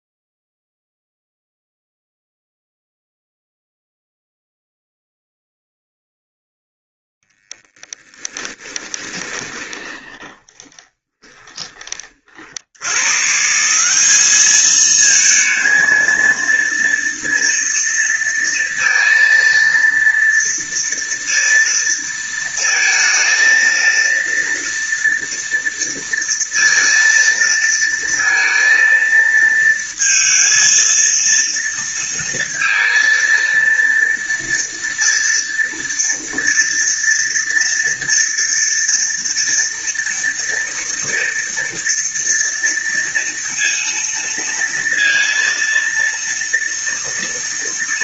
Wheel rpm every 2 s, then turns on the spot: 0, 0, 0, 0, 10, 20, 100, 220, 230, 230, 230, 230, 240, 230, 230, 230, 230, 230, 230, 230, 230, 230, 230, 230.
8-12